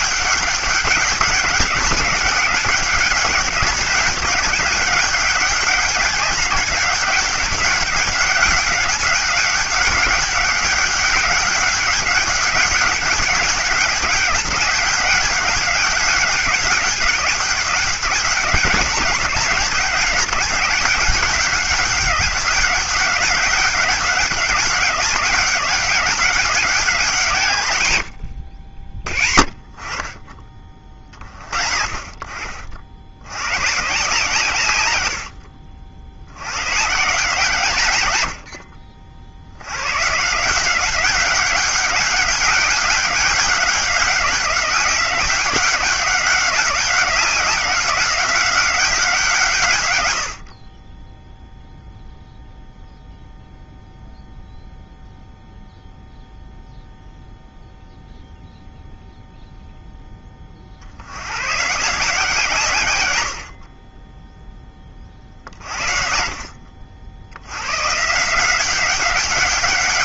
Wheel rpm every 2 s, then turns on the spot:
200, 200, 200, 200, 200, 200, 200, 200, 200, 190, 200, 200, 200, 200, 70, 30, 70, 110, 120, 40, 170, 200, 190, 190, 190, 30, 0, 0, 0, 0, 50, 130, 20, 60, 190.
none